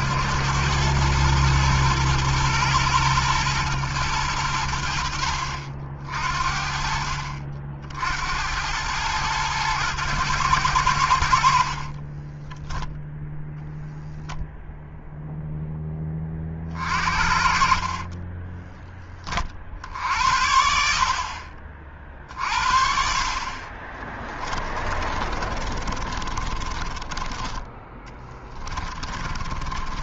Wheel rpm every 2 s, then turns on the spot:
110, 120, 70, 60, 110, 80, 0, 0, 50, 20, 50, 50, 30, 30, 30.
24-30